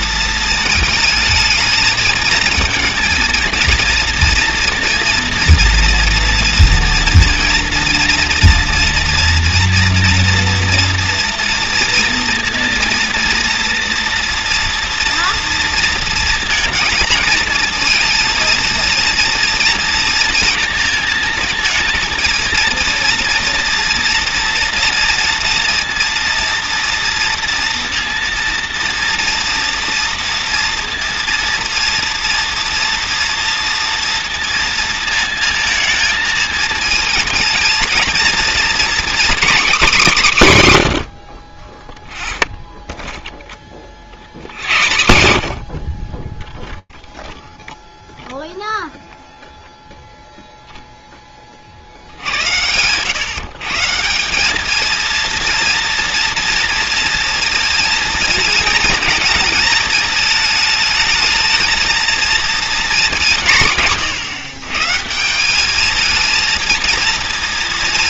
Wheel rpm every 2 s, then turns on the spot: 220, 230, 240, 230, 230, 230, 230, 230, 230, 230, 230, 230, 230, 230, 230, 230, 230, 230, 220, 240, 170, 0, 100, 0, 0, 0, 100, 210, 230, 220, 220, 230, 140, 220.
none